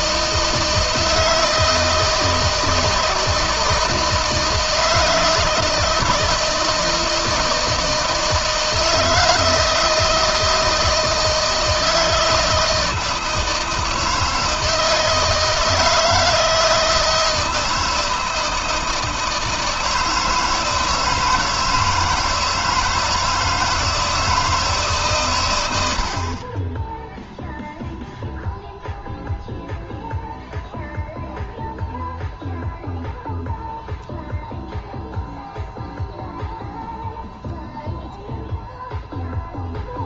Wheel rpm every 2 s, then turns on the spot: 160, 170, 160, 160, 160, 160, 160, 160, 160, 160, 160, 170, 140, 0, 0, 0, 0, 0, 0, 0.
none